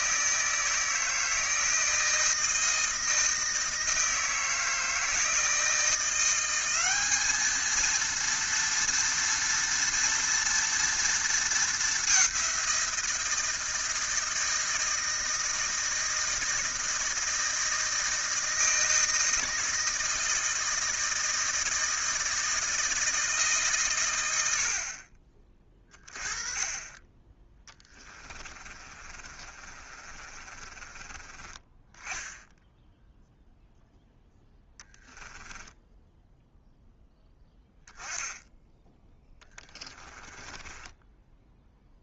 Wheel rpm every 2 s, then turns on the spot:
160, 160, 160, 200, 230, 230, 180, 160, 160, 160, 160, 160, 50, 20, 30, 30, 10, 0, 0, 20, 10.
28-32 38-42